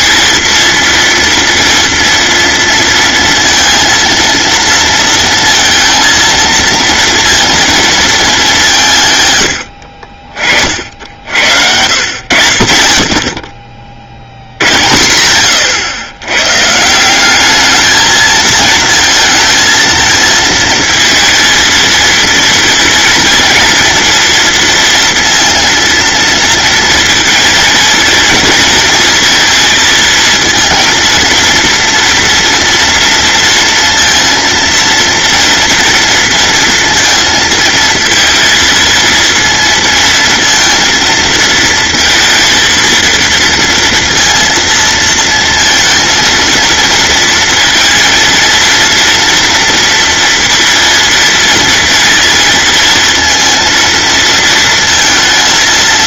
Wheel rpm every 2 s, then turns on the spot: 230, 230, 230, 230, 170, 40, 60, 100, 150, 220, 220, 230, 230, 230, 230, 220, 230, 230, 230, 230, 230, 230, 230, 230, 230, 230, 230, 230.
14-16